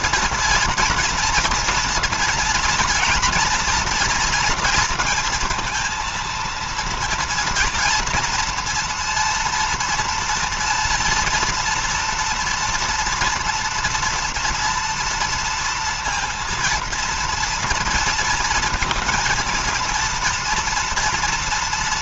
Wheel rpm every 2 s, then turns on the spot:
230, 240, 230, 230, 230, 230, 240, 230, 230, 230, 230.
none